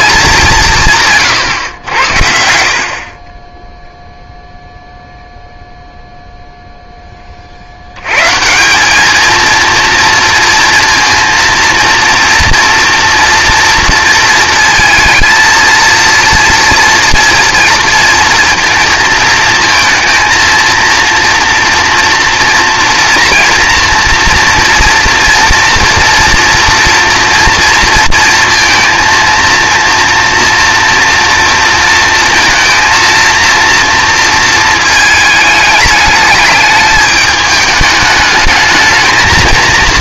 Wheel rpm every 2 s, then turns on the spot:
180, 70, 0, 0, 160, 230, 230, 230, 230, 230, 230, 230, 230, 240, 230, 230, 230, 230, 210, 220.
none